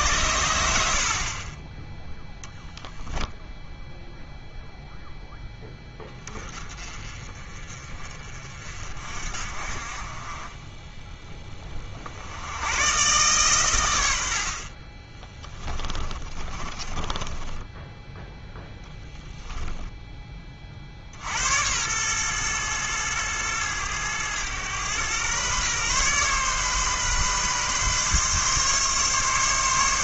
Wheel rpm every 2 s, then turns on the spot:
80, 0, 0, 30, 50, 20, 100, 60, 30, 10, 30, 120, 110, 130, 140.
16-18